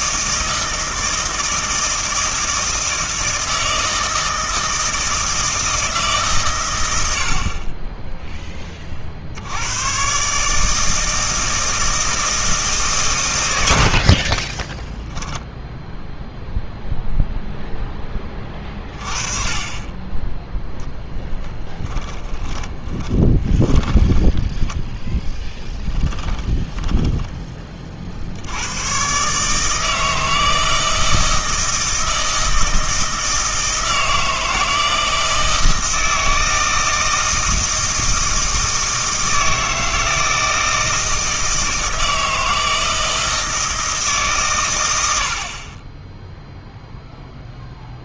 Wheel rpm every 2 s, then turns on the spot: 160, 160, 160, 120, 20, 150, 160, 20, 0, 30, 0, 20, 10, 20, 90, 160, 160, 160, 160, 160, 160, 160, 120, 0.
14-16 22-24 26-28